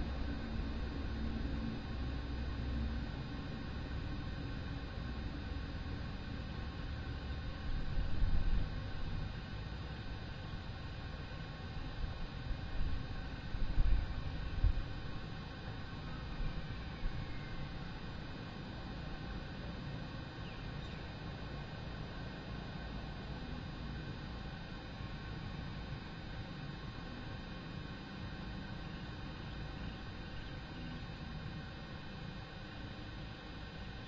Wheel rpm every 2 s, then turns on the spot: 0, 0, 0, 0, 0, 0, 0, 0, 0, 0, 0, 0, 0, 0, 0, 0, 0.
none